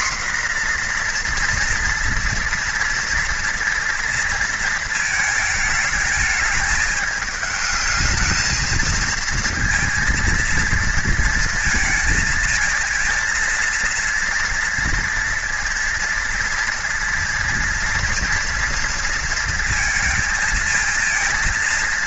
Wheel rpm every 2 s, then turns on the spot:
240, 230, 230, 220, 230, 230, 230, 230, 230, 230, 230.
none